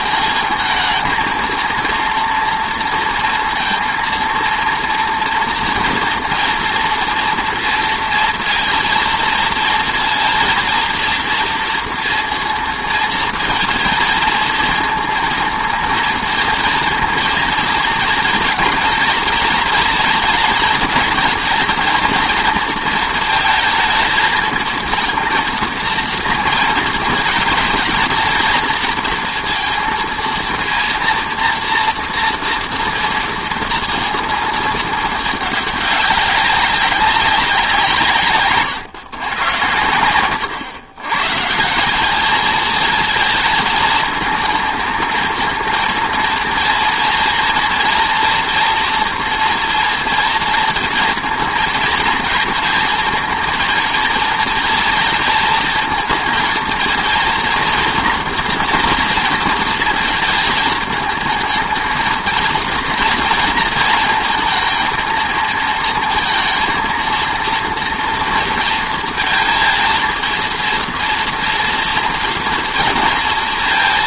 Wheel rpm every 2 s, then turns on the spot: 220, 230, 230, 230, 230, 230, 230, 230, 230, 230, 220, 230, 230, 230, 230, 230, 230, 230, 200, 130, 110, 220, 220, 230, 230, 230, 220, 230, 230, 240, 220, 230, 230, 230, 230, 230, 230.
38-40